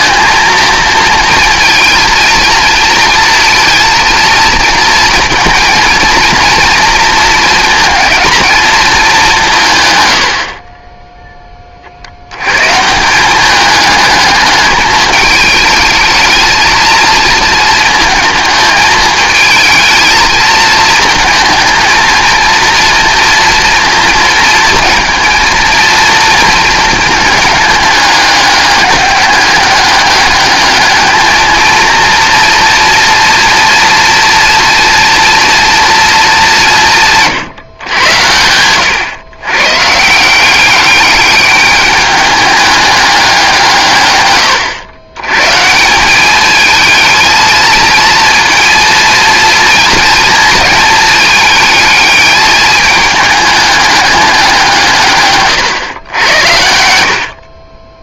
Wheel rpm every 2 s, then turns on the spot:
230, 230, 230, 230, 220, 40, 120, 210, 230, 220, 220, 230, 230, 230, 200, 210, 230, 240, 210, 110, 180, 210, 110, 210, 230, 220, 210, 180, 80.
10-12